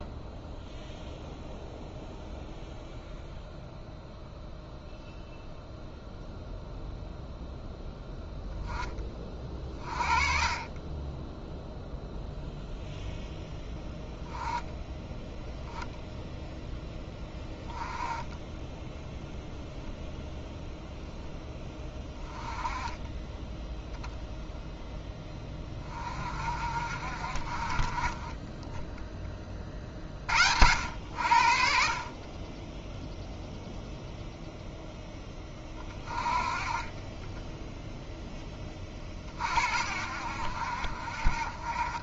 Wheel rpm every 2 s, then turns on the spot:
0, 0, 0, 0, 10, 20, 0, 10, 10, 10, 10, 20, 10, 50, 10, 80, 10, 0, 30, 20, 60.
none